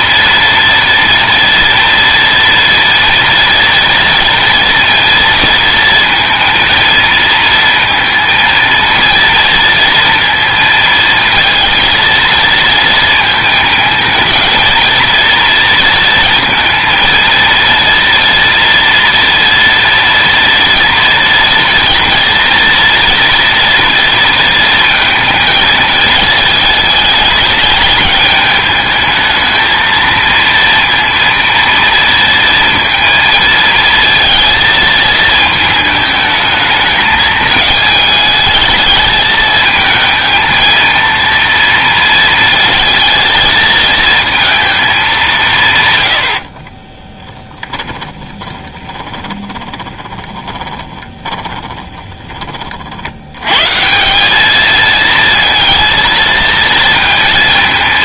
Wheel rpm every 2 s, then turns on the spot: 230, 230, 230, 230, 230, 230, 230, 230, 230, 230, 230, 230, 230, 220, 210, 230, 230, 220, 220, 220, 220, 230, 220, 40, 20, 20, 50, 220, 230.
46-52